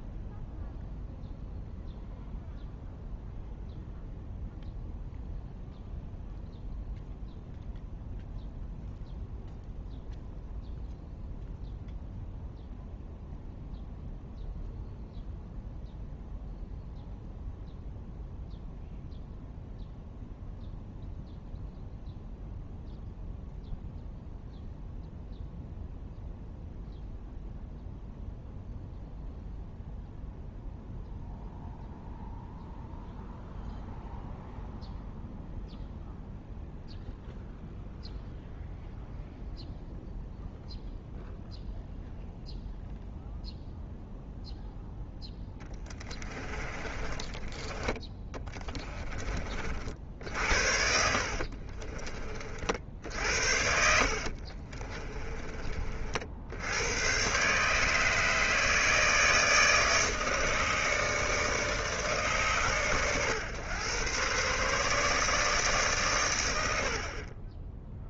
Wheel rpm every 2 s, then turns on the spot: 0, 0, 0, 0, 0, 0, 0, 0, 0, 0, 0, 0, 0, 0, 0, 0, 0, 0, 0, 0, 0, 0, 0, 20, 20, 60, 30, 60, 60, 150, 150, 140, 130, 120.
46-50 54-56